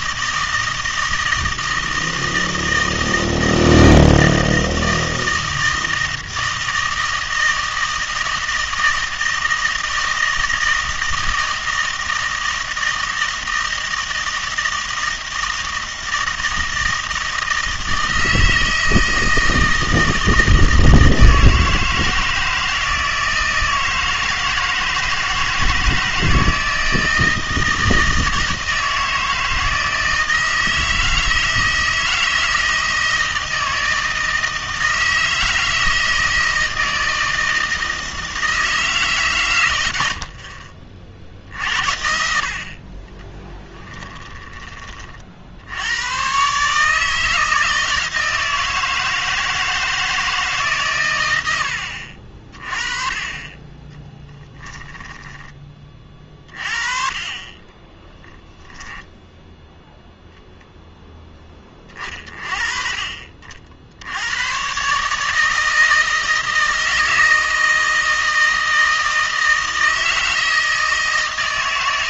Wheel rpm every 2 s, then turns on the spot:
160, 160, 160, 160, 160, 160, 160, 160, 160, 160, 160, 160, 160, 160, 160, 160, 160, 160, 160, 160, 50, 60, 20, 140, 160, 140, 30, 10, 40, 10, 0, 40, 120, 160, 160, 160.
54-56